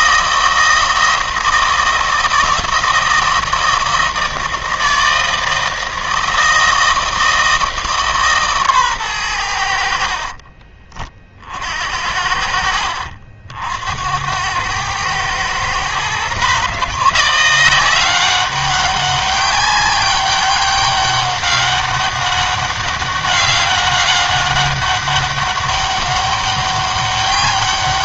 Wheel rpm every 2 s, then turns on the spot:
160, 160, 160, 160, 130, 30, 70, 110, 150, 200, 200, 200, 200, 200.
none